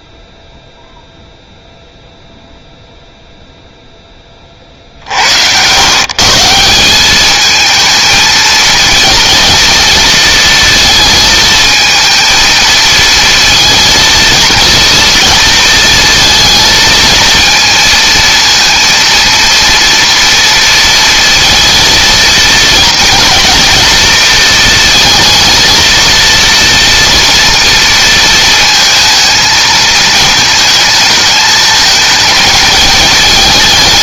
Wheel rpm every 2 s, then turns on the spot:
0, 0, 50, 190, 230, 230, 220, 230, 230, 230, 230, 230, 230, 230, 230, 220, 220.
none